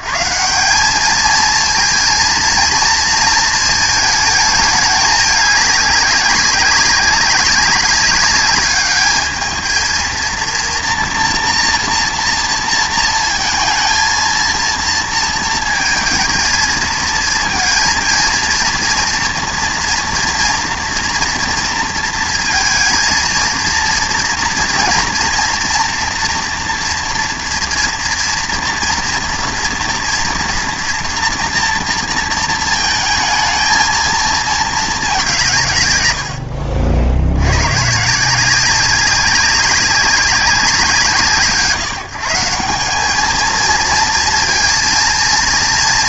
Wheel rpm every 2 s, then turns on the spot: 140, 230, 210, 200, 200, 230, 230, 230, 220, 230, 230, 220, 230, 240, 230, 230, 220, 220, 70, 190, 180, 190, 230.
36-38